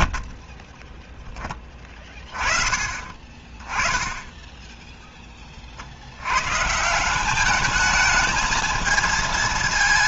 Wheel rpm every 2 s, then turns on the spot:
20, 20, 20, 170, 230.
none